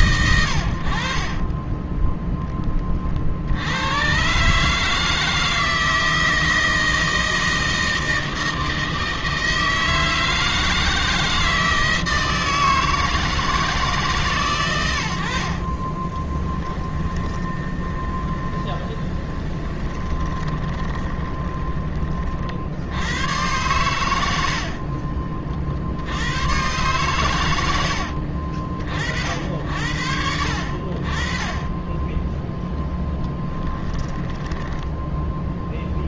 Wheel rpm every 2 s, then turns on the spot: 100, 30, 150, 160, 160, 160, 160, 100, 20, 10, 20, 70, 60, 110, 60, 60, 10, 10.
16-22 34-36